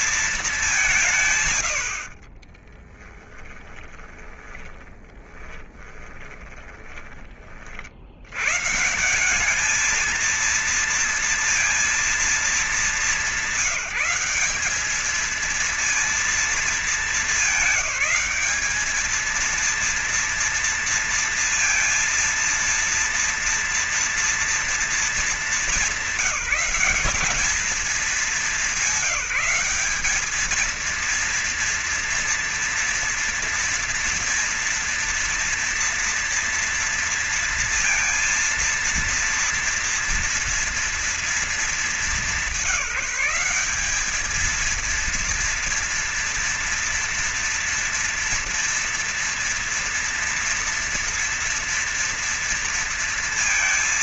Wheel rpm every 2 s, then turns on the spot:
200, 30, 20, 20, 120, 230, 210, 200, 220, 210, 230, 230, 230, 190, 210, 220, 230, 230, 230, 230, 240, 200, 220, 230, 230, 230, 230.
2-8